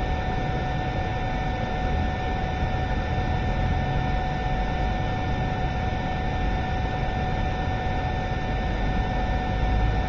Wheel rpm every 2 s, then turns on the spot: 0, 0, 0, 0, 0.
none